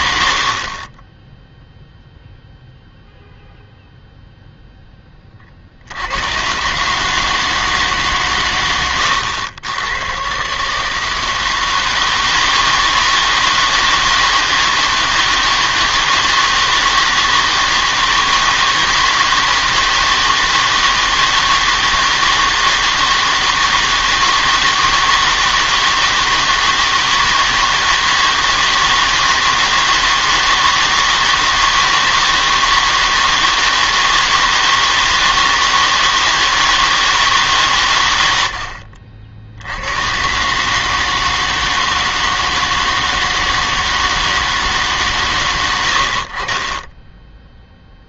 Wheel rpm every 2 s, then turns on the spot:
40, 0, 10, 130, 120, 150, 160, 160, 160, 160, 160, 160, 160, 160, 160, 160, 160, 160, 160, 80, 140, 160, 150, 20.
0-2 46-48